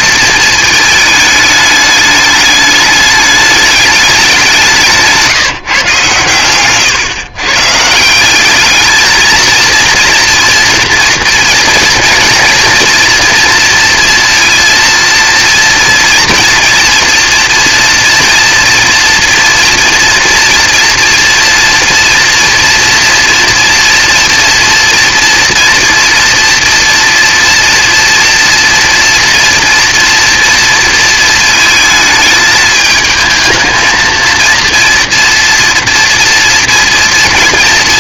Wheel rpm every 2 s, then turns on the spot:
220, 210, 180, 120, 210, 230, 230, 230, 240, 230, 230, 230, 230, 230, 230, 230, 220, 230, 230.
none